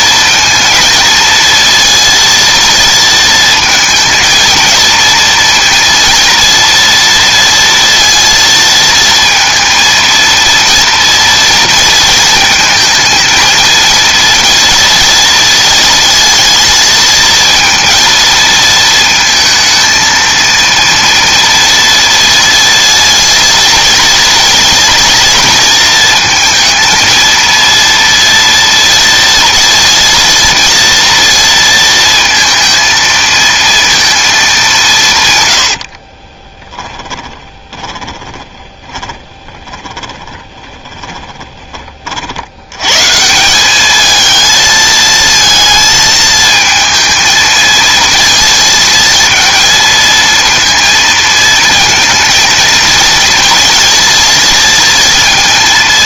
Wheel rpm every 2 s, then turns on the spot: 230, 230, 230, 230, 230, 230, 220, 230, 220, 230, 230, 230, 230, 220, 230, 230, 230, 190, 10, 20, 20, 100, 220, 230, 230, 230, 220, 230.
36-42